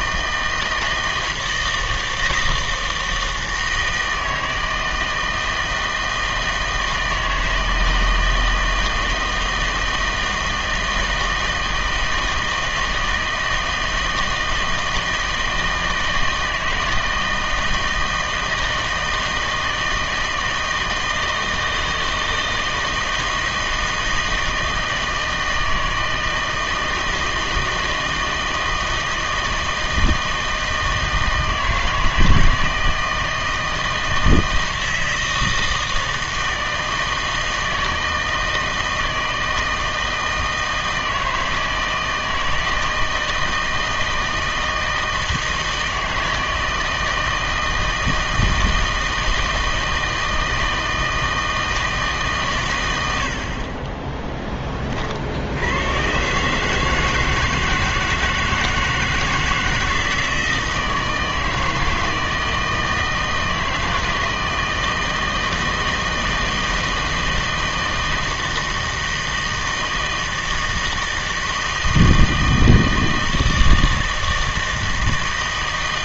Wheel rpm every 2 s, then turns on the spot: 160, 160, 160, 160, 160, 160, 160, 160, 160, 160, 160, 160, 160, 160, 160, 160, 160, 160, 160, 160, 160, 160, 160, 160, 160, 160, 120, 30, 150, 160, 160, 160, 160, 160, 160, 160, 160, 160.
none